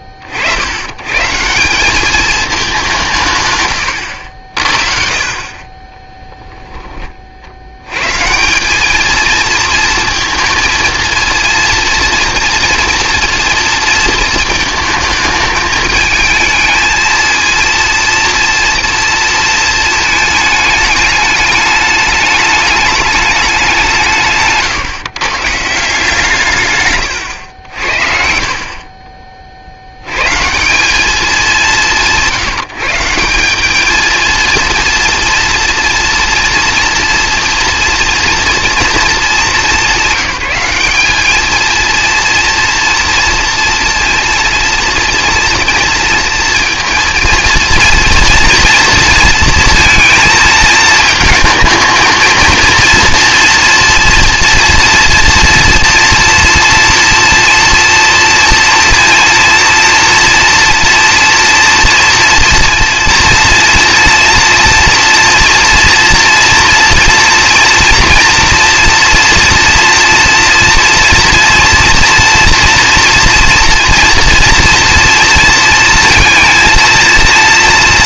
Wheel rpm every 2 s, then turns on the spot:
50, 200, 50, 10, 180, 230, 230, 220, 220, 230, 220, 210, 140, 150, 50, 150, 170, 230, 230, 230, 200, 230, 230, 230, 230, 220, 230, 230, 240, 230, 230, 230, 240, 230, 240, 230, 230, 230, 230.
none